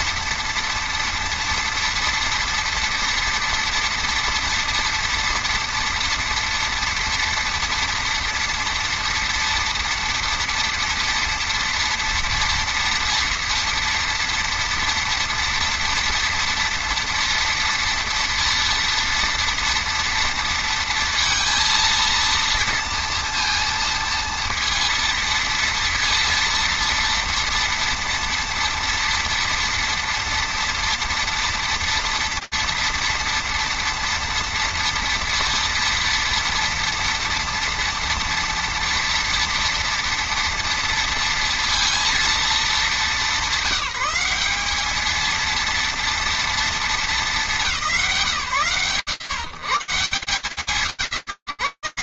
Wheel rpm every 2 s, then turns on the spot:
240, 230, 230, 230, 230, 230, 230, 230, 230, 230, 230, 230, 230, 230, 230, 230, 230, 230, 230, 230, 230, 210, 200, 230, 140, 150.
none